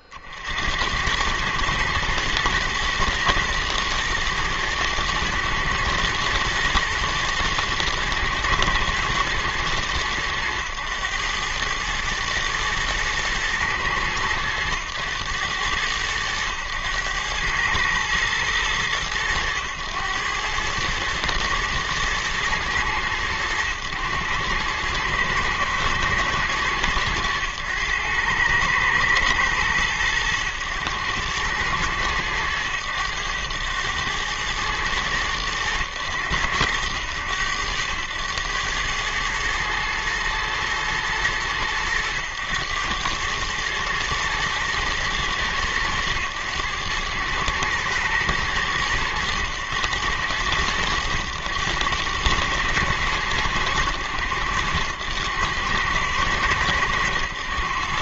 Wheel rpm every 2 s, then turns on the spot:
40, 110, 120, 110, 110, 100, 110, 100, 90, 110, 100, 110, 100, 110, 110, 100, 100, 110, 90, 100, 110, 100, 110, 110, 110, 100, 110, 90, 110.
none